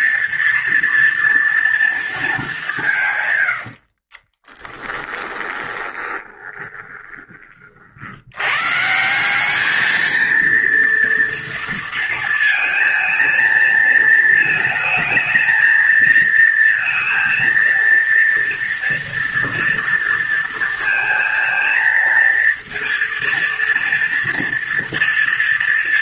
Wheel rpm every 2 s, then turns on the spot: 230, 170, 20, 20, 150, 230, 230, 220, 230, 230, 230, 230, 230.
4-8